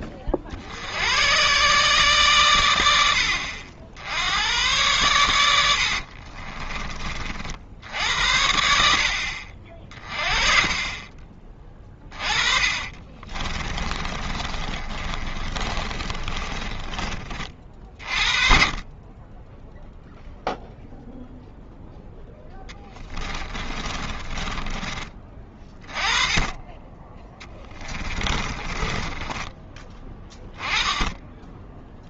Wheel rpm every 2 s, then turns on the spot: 50, 110, 100, 30, 60, 30, 30, 30, 20, 30, 0, 10, 20, 10, 20, 10.
6-8 12-18 22-26 28-30